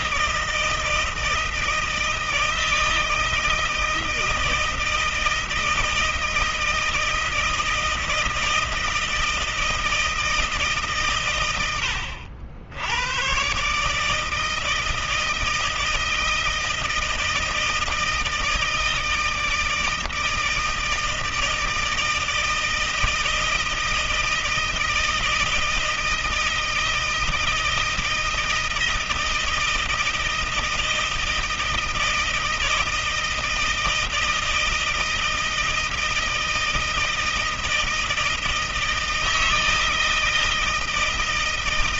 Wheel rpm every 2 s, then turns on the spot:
160, 160, 160, 160, 160, 140, 90, 160, 160, 160, 160, 160, 160, 160, 160, 160, 160, 160, 160, 160, 160.
none